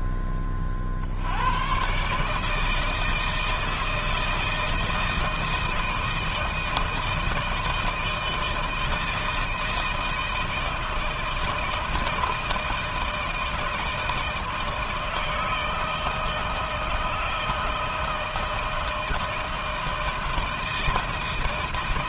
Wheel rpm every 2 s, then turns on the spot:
60, 160, 160, 160, 160, 160, 160, 160, 160, 160, 160.
none